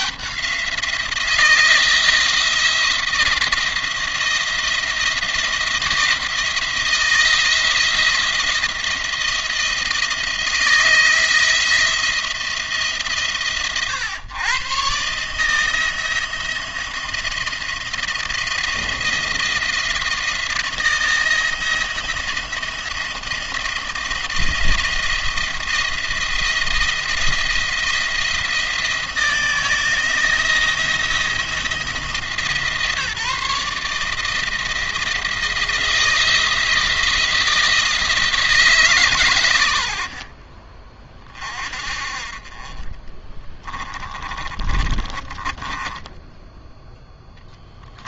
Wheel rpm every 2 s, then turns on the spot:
170, 170, 170, 160, 170, 170, 150, 120, 170, 170, 170, 170, 170, 170, 160, 170, 160, 160, 160, 160, 40, 30, 30, 10.
44-46